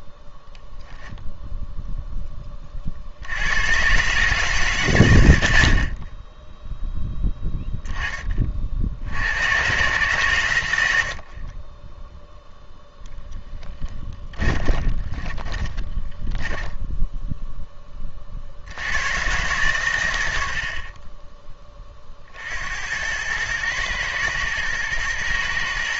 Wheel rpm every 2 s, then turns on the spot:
0, 30, 110, 0, 70, 80, 0, 30, 10, 80, 60, 80, 110.
14-18 20-22